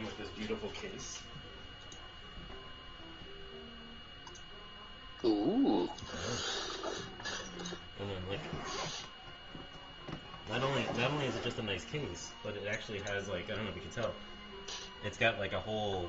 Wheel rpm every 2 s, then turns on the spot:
0, 0, 0, 0, 0, 0, 0, 0.
none